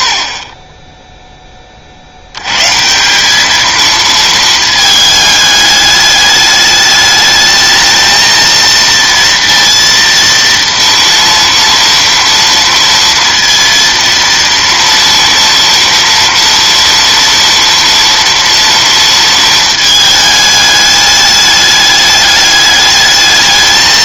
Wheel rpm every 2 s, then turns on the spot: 20, 120, 220, 210, 230, 230, 230, 230, 230, 230, 210, 210.
none